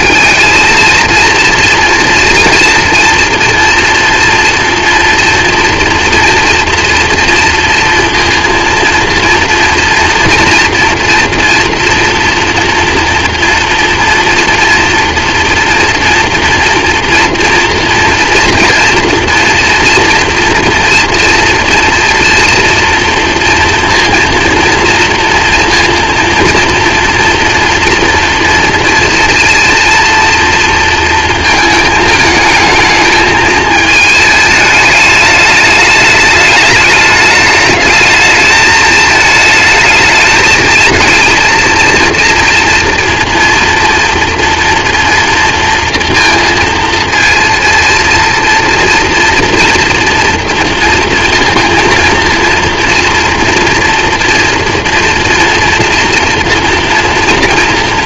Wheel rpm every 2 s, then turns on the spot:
220, 230, 240, 230, 230, 230, 230, 230, 230, 230, 230, 240, 230, 230, 230, 230, 220, 210, 210, 220, 220, 230, 230, 230, 230, 230, 230, 230, 230.
none